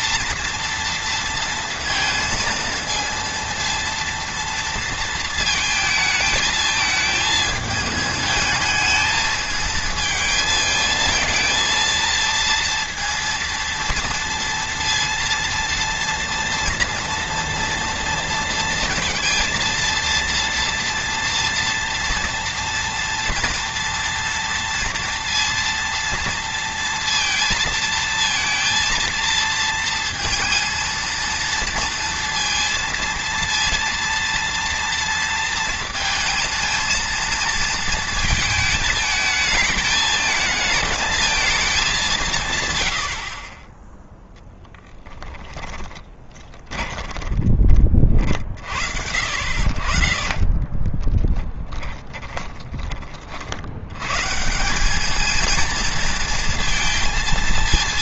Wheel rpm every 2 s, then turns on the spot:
230, 230, 230, 220, 220, 220, 230, 230, 230, 230, 230, 230, 230, 230, 230, 230, 230, 230, 230, 220, 230, 90, 10, 10, 60, 20, 40, 200, 230.
46-48 50-52